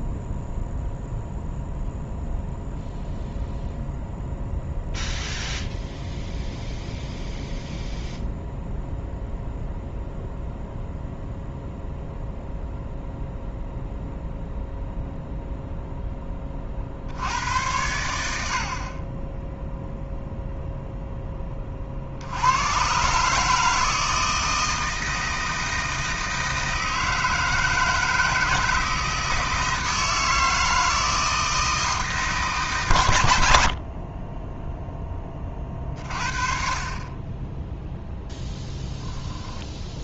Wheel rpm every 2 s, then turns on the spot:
0, 0, 0, 0, 0, 0, 0, 0, 40, 60, 0, 110, 160, 160, 160, 160, 130, 10, 30, 0.
none